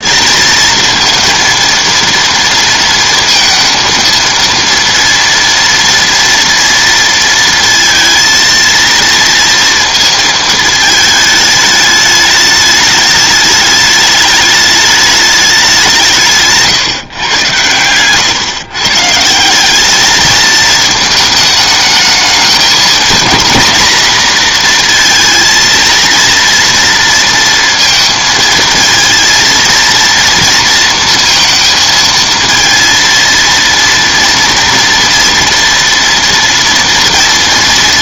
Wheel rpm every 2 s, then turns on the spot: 230, 230, 230, 230, 230, 220, 210, 210, 150, 130, 220, 230, 230, 230, 230, 230, 230, 230, 230.
none